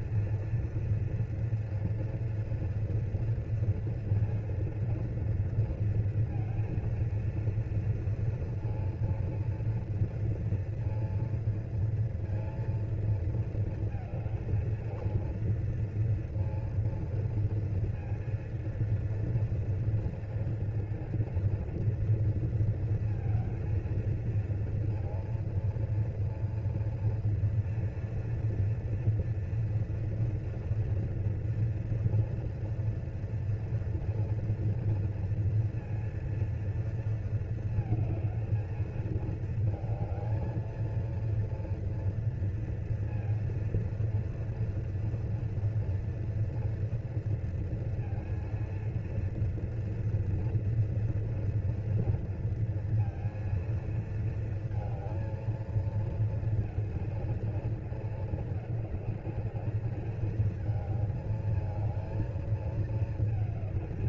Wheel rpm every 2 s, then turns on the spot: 240, 240, 230, 230, 230, 230, 230, 220, 230, 230, 230, 230, 230, 230, 230, 240, 230, 230, 230, 220, 220, 230, 240, 240, 230, 230, 230, 230, 230, 220, 220, 220.
none